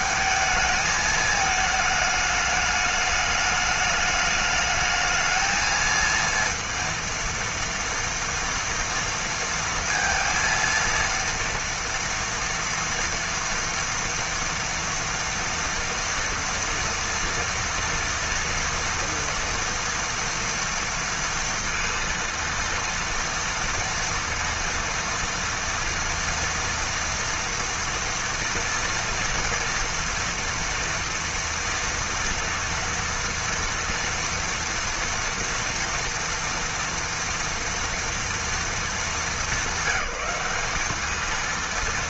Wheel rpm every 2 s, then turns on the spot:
220, 210, 220, 230, 230, 230, 230, 230, 240, 240, 230, 230, 230, 230, 240, 230, 230, 230, 230, 210, 230.
none